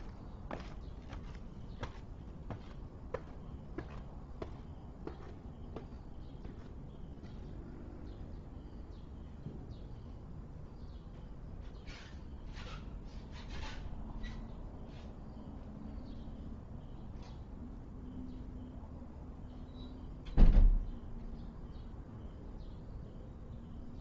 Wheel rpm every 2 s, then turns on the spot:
0, 0, 0, 0, 0, 0, 0, 0, 0, 0, 0, 0.
none